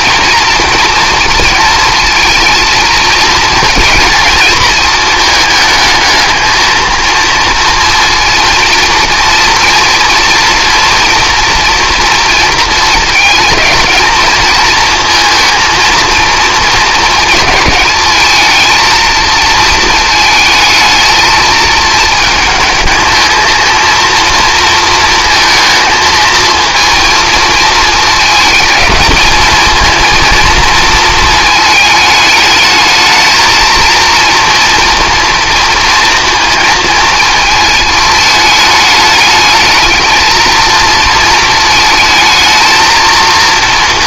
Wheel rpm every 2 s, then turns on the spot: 230, 220, 220, 220, 230, 230, 220, 220, 220, 220, 220, 220, 230, 230, 220, 230, 220, 230, 230, 220, 230, 220.
none